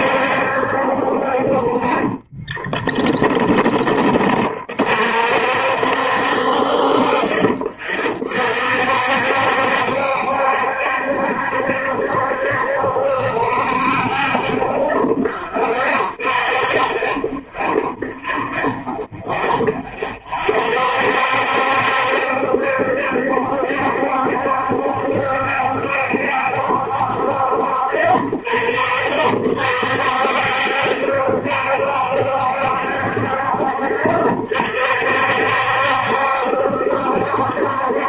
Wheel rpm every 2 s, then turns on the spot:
60, 20, 40, 50, 50, 70, 70, 50, 30, 20, 50, 70, 70, 60, 40, 70, 70, 50, 70.
2-4